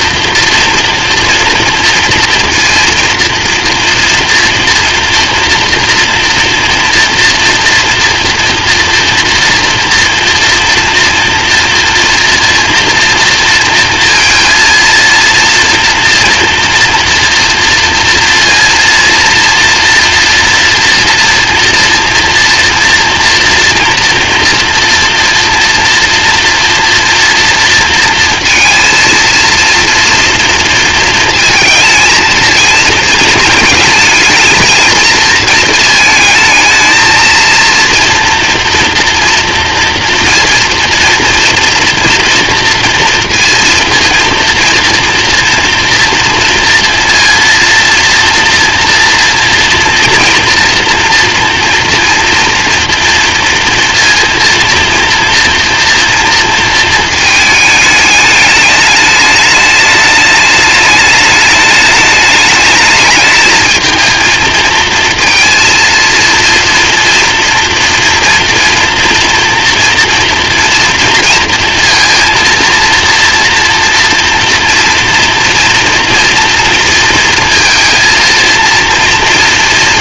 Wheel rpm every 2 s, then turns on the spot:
230, 230, 230, 230, 230, 230, 240, 230, 230, 230, 230, 240, 230, 230, 230, 230, 230, 230, 220, 230, 240, 230, 230, 230, 230, 230, 230, 230, 220, 210, 220, 220, 230, 230, 240, 230, 230, 230, 230, 230.
none